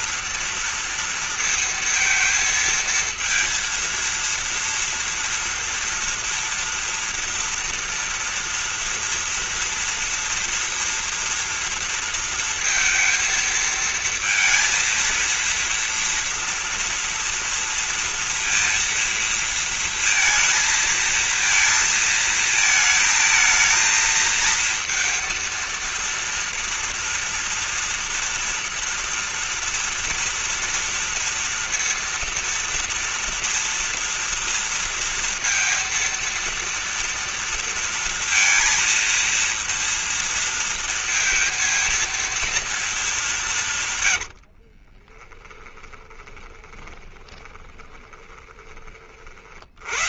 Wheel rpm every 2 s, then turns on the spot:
230, 230, 230, 230, 230, 230, 230, 230, 230, 230, 230, 220, 230, 230, 240, 230, 230, 230, 230, 230, 230, 230, 80, 20, 20.
44-48